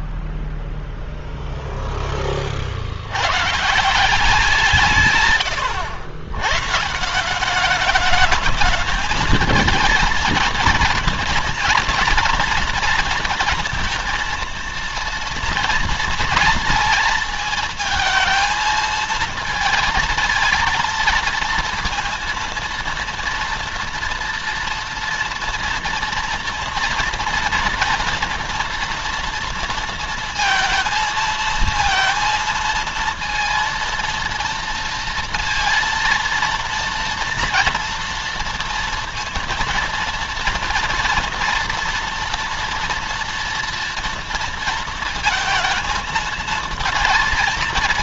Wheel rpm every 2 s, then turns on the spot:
0, 70, 160, 150, 210, 230, 230, 230, 230, 220, 230, 230, 230, 230, 230, 230, 230, 230, 230, 230, 230, 240, 230, 220.
none